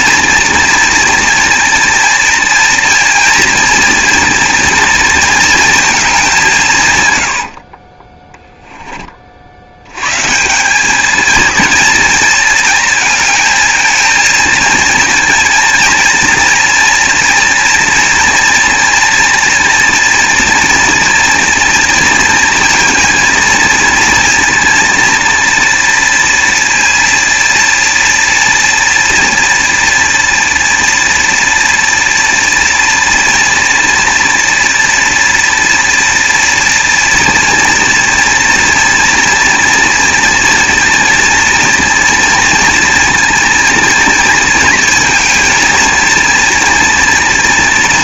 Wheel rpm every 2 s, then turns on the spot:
230, 230, 230, 150, 10, 190, 230, 230, 230, 240, 230, 230, 230, 230, 230, 230, 230, 230, 230, 240, 230, 230, 230, 230.
none